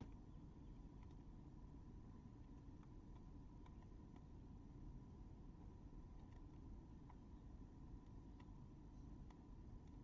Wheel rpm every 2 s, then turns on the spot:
0, 0, 0, 0, 0.
none